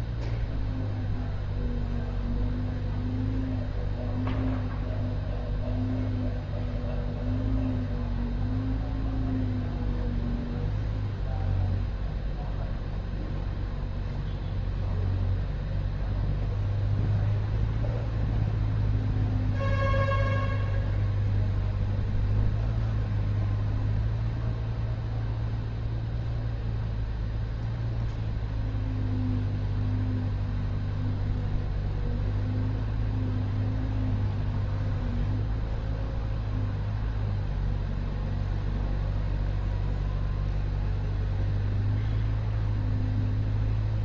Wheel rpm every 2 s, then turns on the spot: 0, 0, 0, 0, 0, 0, 0, 0, 0, 0, 0, 0, 0, 0, 0, 0, 0, 0, 0, 0, 0, 0.
none